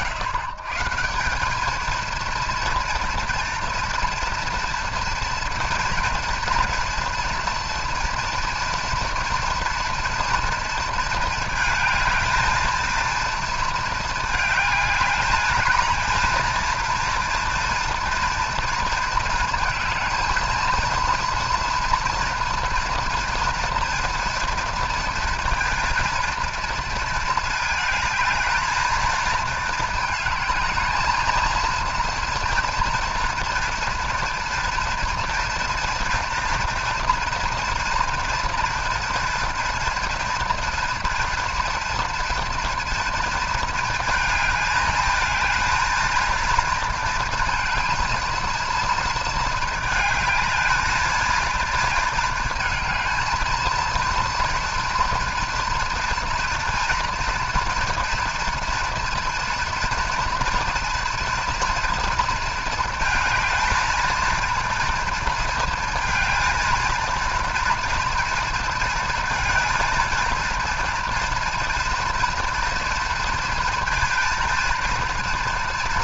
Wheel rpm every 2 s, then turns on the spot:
140, 230, 230, 230, 230, 230, 230, 210, 230, 230, 230, 240, 230, 230, 220, 220, 240, 230, 230, 240, 240, 230, 220, 230, 230, 220, 220, 230, 230, 230, 240, 220, 230, 230, 230, 230, 230, 230.
none